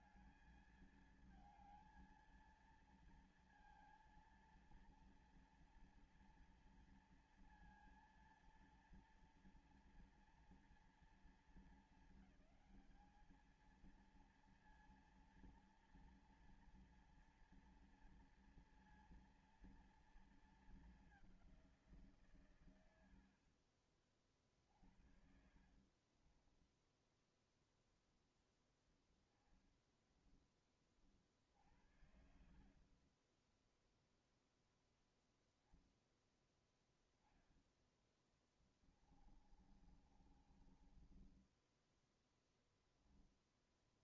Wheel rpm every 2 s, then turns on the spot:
220, 230, 230, 230, 230, 230, 210, 230, 230, 230, 220, 150, 40, 30, 10, 10, 50, 0, 0, 10, 40, 10.
26-28 32-34 38-44